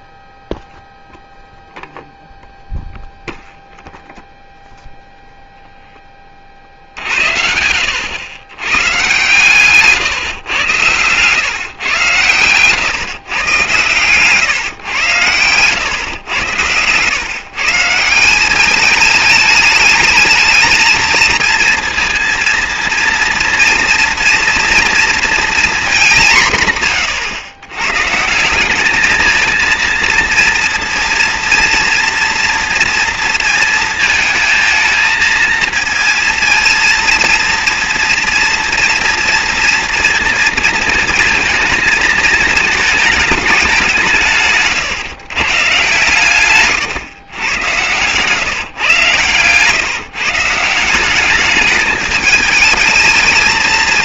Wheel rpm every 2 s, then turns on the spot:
0, 0, 0, 50, 120, 120, 110, 140, 100, 200, 220, 230, 230, 150, 180, 230, 230, 220, 230, 240, 230, 220, 140, 140, 140, 170, 220.
14-16 46-48